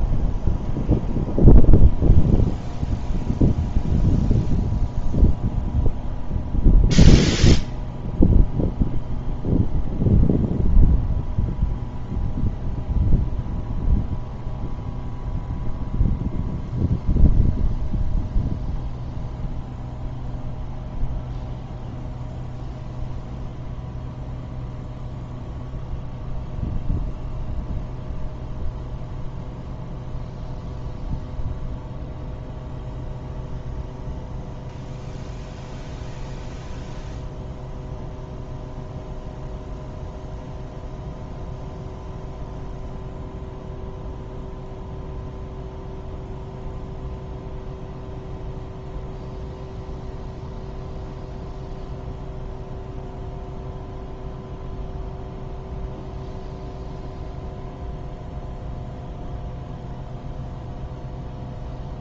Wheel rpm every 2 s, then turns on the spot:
0, 0, 0, 0, 0, 0, 0, 0, 0, 0, 0, 0, 0, 0, 0, 0, 0, 0, 0, 0, 0, 0, 0, 0, 0, 0, 0, 0, 0, 0, 0.
none